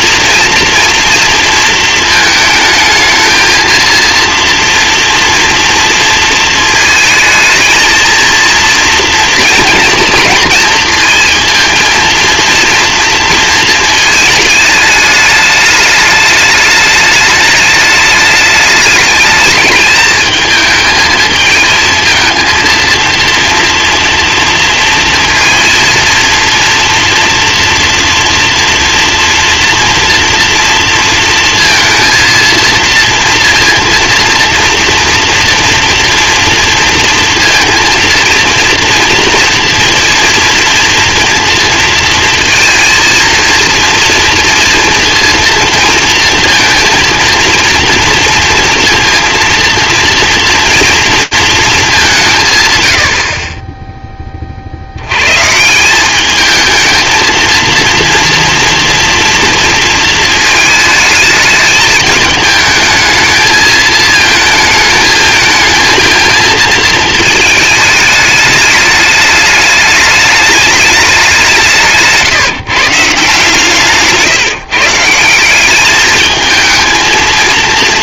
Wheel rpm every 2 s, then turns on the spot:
240, 220, 230, 230, 230, 230, 230, 210, 210, 210, 220, 230, 230, 240, 230, 230, 230, 230, 230, 230, 230, 230, 230, 230, 230, 230, 120, 50, 220, 230, 220, 210, 220, 220, 210, 220, 150, 140, 220.
none